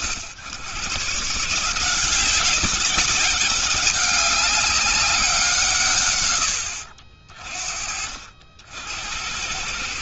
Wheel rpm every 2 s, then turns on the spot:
70, 180, 190, 100, 50.
6-8